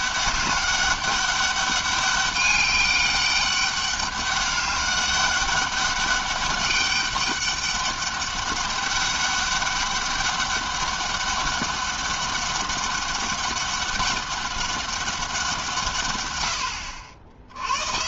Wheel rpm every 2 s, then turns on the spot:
200, 200, 200, 200, 200, 200, 200, 200, 90.
none